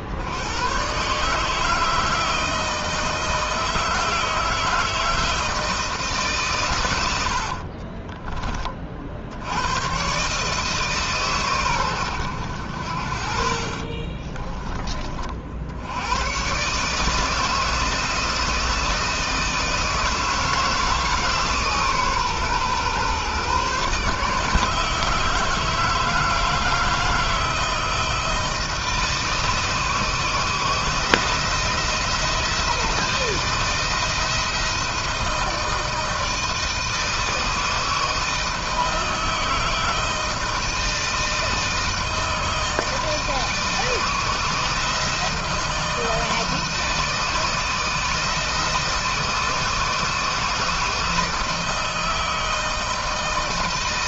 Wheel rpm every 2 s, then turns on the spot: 110, 160, 160, 130, 40, 150, 70, 30, 130, 160, 160, 130, 150, 160, 160, 160, 170, 160, 160, 160, 170, 160, 160, 160, 160, 160, 160.
none